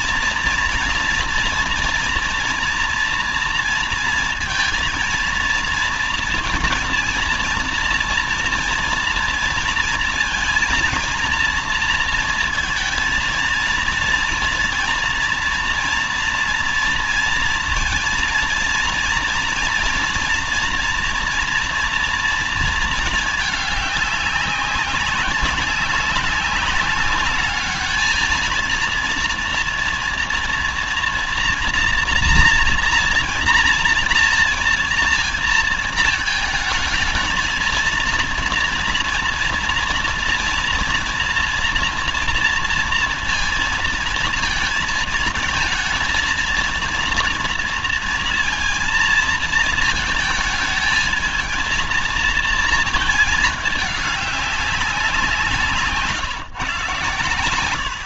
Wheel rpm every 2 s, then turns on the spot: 230, 240, 230, 230, 230, 230, 230, 230, 230, 230, 240, 230, 190, 190, 220, 230, 240, 230, 220, 230, 230, 230, 230, 220, 230, 220, 230, 200, 150.
none